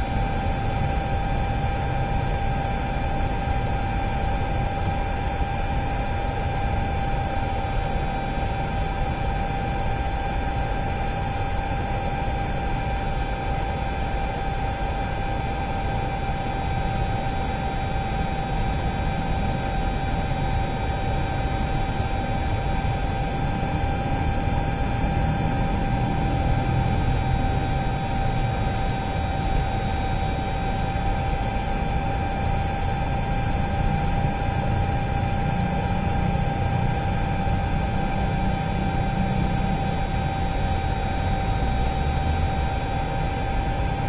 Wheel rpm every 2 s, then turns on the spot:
0, 0, 0, 0, 0, 0, 0, 0, 0, 0, 0, 0, 0, 0, 0, 0, 0, 0, 0, 0, 0, 0.
none